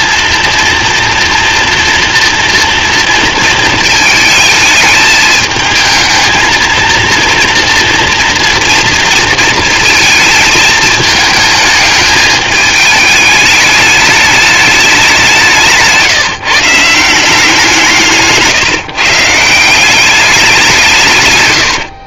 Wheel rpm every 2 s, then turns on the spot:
230, 230, 220, 230, 230, 220, 220, 210, 150, 150, 180.
none